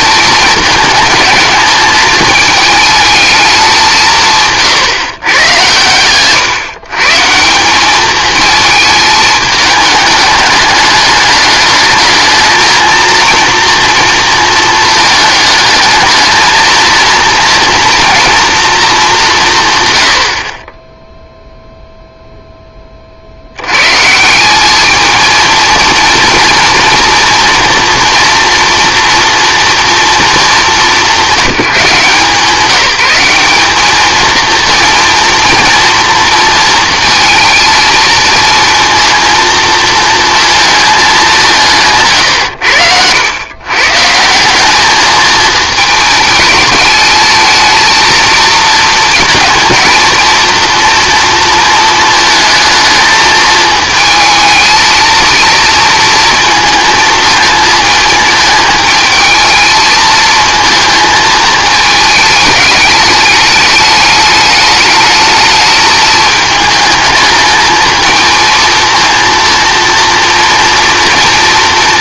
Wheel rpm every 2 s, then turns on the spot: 220, 220, 150, 140, 220, 210, 220, 230, 230, 230, 40, 10, 200, 230, 230, 210, 180, 230, 230, 230, 220, 100, 190, 220, 220, 230, 230, 220, 230, 220, 220, 210, 210, 220, 230, 230.
none